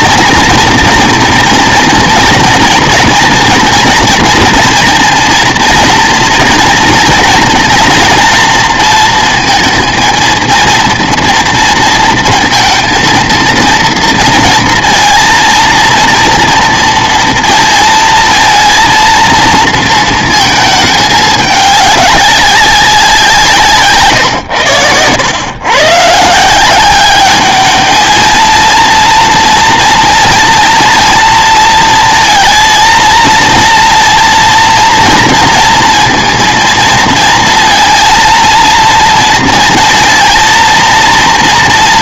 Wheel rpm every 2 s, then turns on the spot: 230, 230, 230, 230, 230, 230, 230, 230, 230, 230, 220, 190, 110, 180, 230, 230, 230, 240, 230, 230, 230.
none